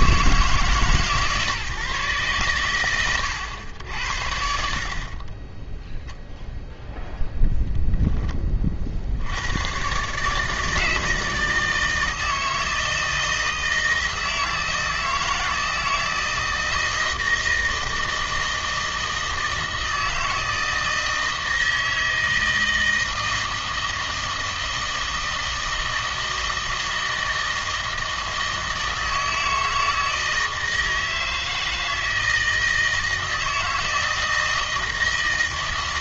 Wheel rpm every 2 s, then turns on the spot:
150, 120, 60, 0, 30, 150, 160, 160, 160, 160, 160, 160, 160, 160, 160, 160, 160, 160.
none